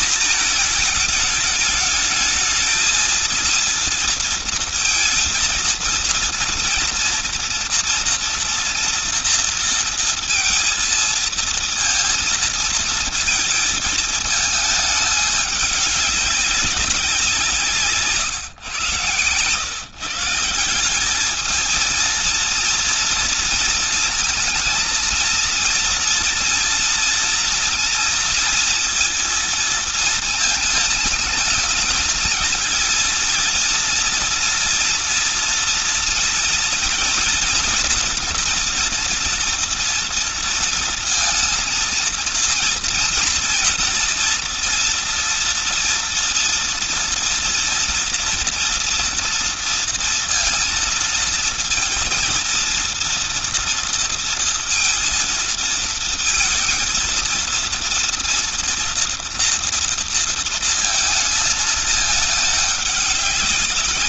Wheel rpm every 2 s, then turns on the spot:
230, 220, 230, 230, 230, 230, 220, 210, 200, 130, 180, 230, 230, 230, 230, 220, 220, 230, 230, 240, 230, 230, 230, 230, 230, 230, 230, 230, 230, 230, 230, 210.
none